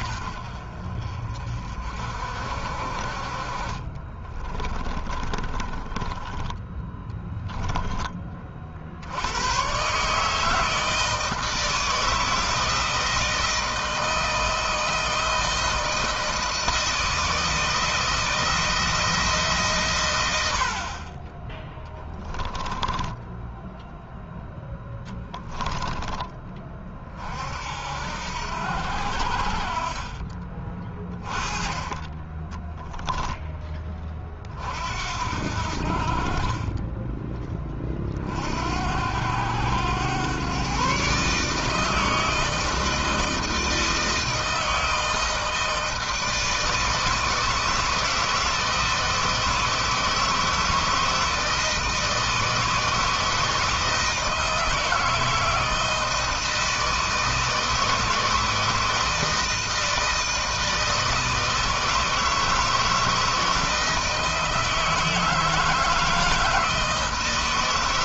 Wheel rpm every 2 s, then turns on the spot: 50, 40, 30, 10, 80, 160, 160, 160, 160, 160, 30, 10, 0, 40, 60, 30, 10, 60, 20, 90, 140, 160, 160, 160, 160, 160, 160, 160, 160, 160, 160, 160, 160, 160.
4-6 22-24 30-34